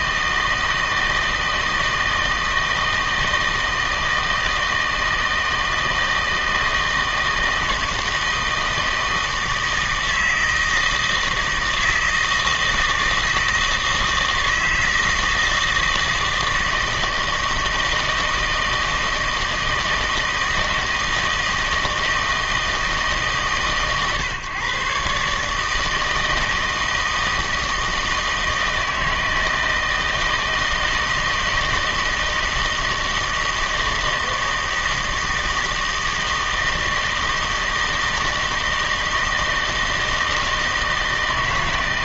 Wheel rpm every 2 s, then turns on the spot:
160, 160, 160, 160, 160, 160, 160, 160, 160, 160, 160, 160, 130, 160, 160, 160, 160, 160, 160, 160, 160.
none